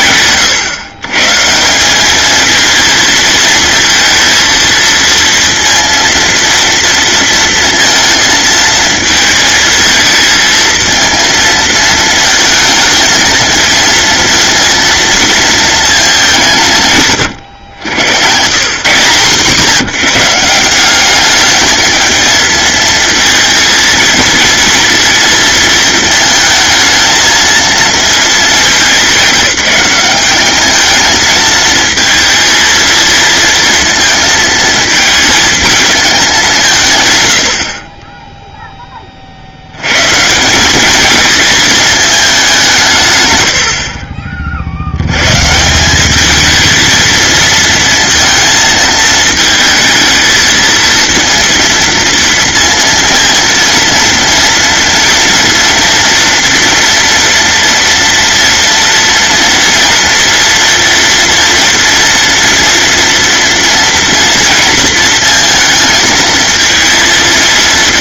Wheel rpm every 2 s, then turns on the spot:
140, 220, 230, 230, 220, 230, 220, 230, 140, 160, 190, 230, 230, 220, 210, 220, 230, 230, 160, 10, 200, 150, 70, 220, 220, 230, 230, 230, 230, 230, 230, 230, 230, 230.
none